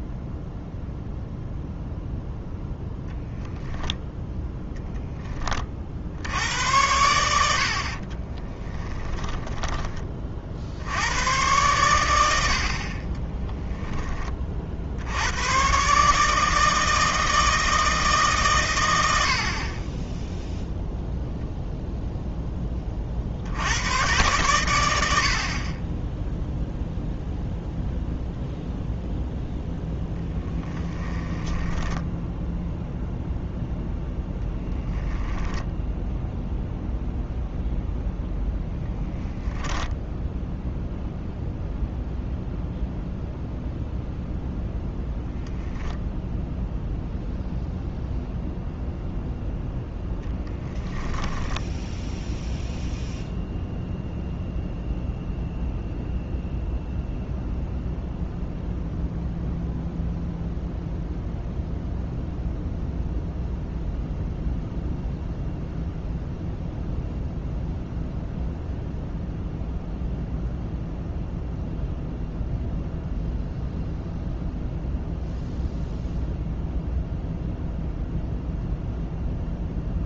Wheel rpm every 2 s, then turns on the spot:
0, 0, 0, 80, 10, 60, 60, 50, 160, 110, 0, 20, 100, 0, 0, 10, 0, 0, 0, 0, 0, 0, 0, 0, 0, 0, 0, 0, 0, 0, 0, 0, 0, 0, 0, 0, 0, 0, 0, 0.
8-10 30-32